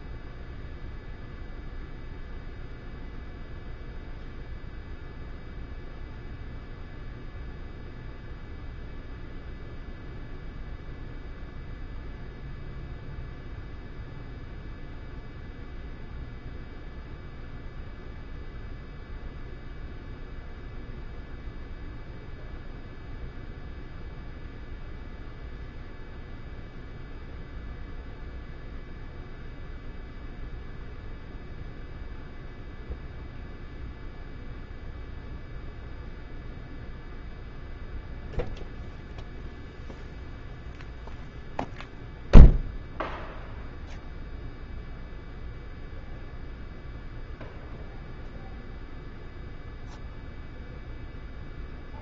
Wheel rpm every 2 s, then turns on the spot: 0, 0, 0, 0, 0, 0, 0, 0, 0, 0, 0, 0, 0, 0, 0, 0, 0, 0, 0, 0, 0, 0, 0, 0, 0, 0.
none